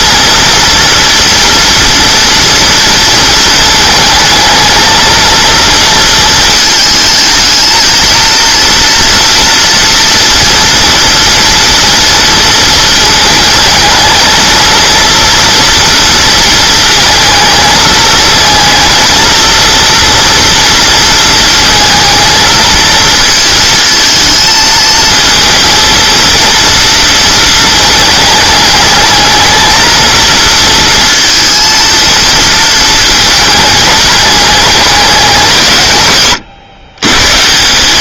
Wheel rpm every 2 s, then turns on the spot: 230, 230, 220, 220, 230, 230, 220, 230, 230, 230, 230, 220, 220, 230, 210, 230, 230, 200, 100.
none